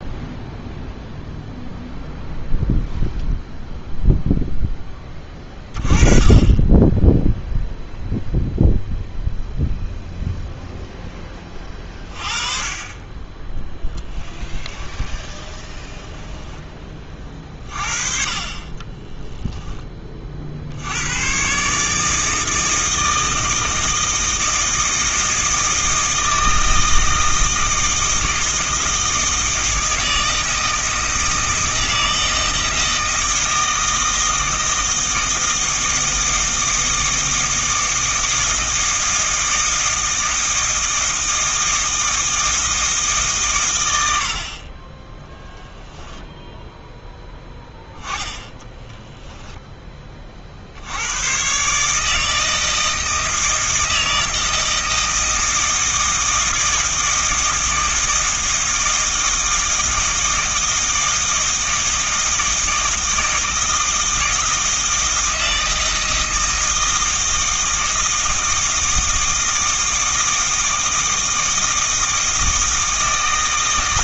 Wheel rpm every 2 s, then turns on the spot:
0, 0, 10, 10, 0, 0, 30, 20, 20, 20, 70, 160, 160, 160, 160, 160, 160, 160, 160, 160, 160, 160, 20, 10, 10, 70, 160, 160, 160, 160, 160, 160, 160, 160, 160, 160, 160.
14-16 18-20 48-50